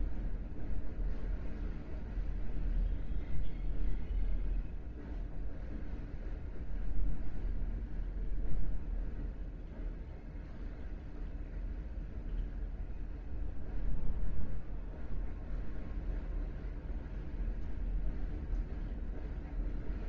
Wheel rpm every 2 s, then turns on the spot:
0, 0, 0, 0, 0, 0, 0, 0, 0, 0.
none